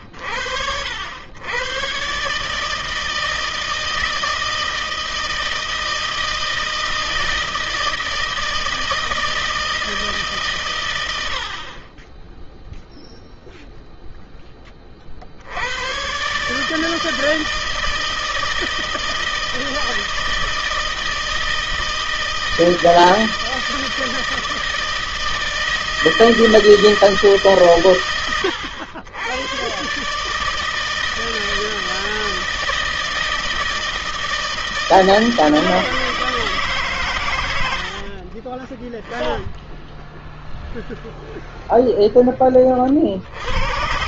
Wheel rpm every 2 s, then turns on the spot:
90, 160, 160, 160, 160, 70, 0, 90, 160, 160, 160, 160, 160, 130, 130, 160, 160, 160, 70, 10, 0, 110.
36-38